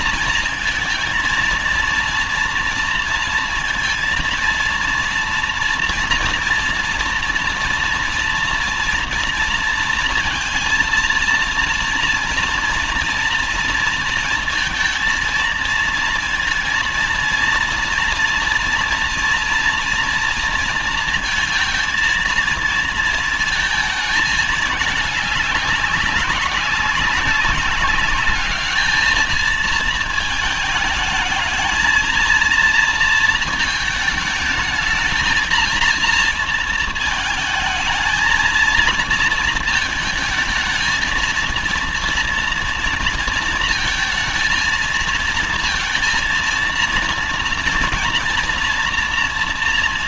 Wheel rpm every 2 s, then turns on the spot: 230, 230, 230, 240, 230, 230, 240, 230, 230, 230, 230, 230, 220, 190, 210, 220, 230, 220, 220, 220, 220, 230, 230, 230, 230.
none